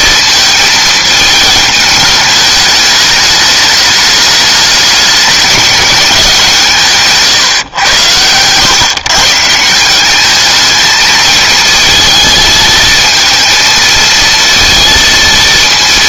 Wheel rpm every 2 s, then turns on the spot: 220, 210, 210, 170, 130, 220, 220, 230.
none